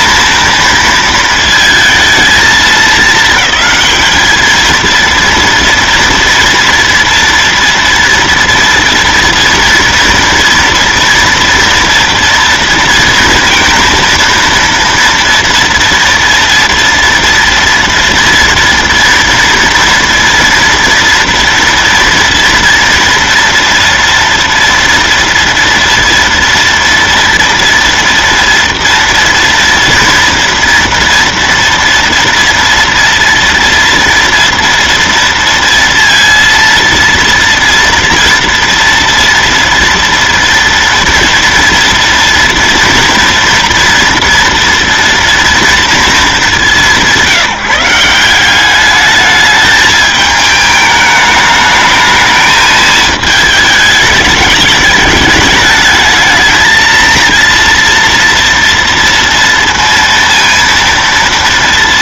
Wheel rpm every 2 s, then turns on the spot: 230, 220, 220, 230, 230, 230, 230, 230, 230, 230, 230, 230, 240, 230, 230, 230, 230, 230, 230, 230, 230, 230, 230, 210, 190, 220, 220, 210, 220, 240, 230.
none